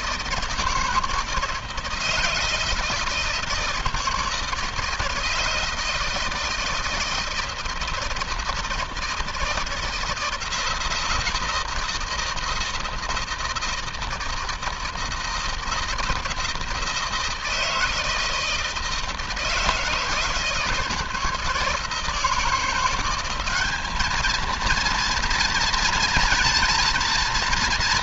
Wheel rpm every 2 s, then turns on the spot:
160, 160, 160, 160, 160, 160, 160, 160, 160, 160, 160, 170, 230, 230.
none